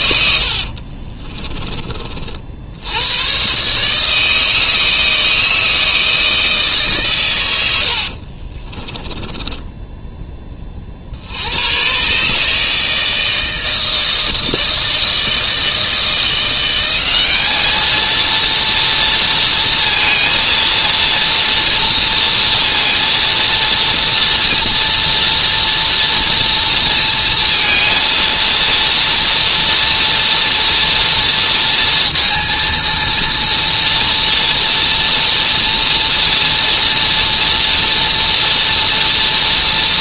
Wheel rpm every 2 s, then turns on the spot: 60, 70, 160, 150, 30, 30, 150, 160, 180, 230, 230, 240, 240, 230, 230, 230, 230, 230, 230, 230.
0-2 8-10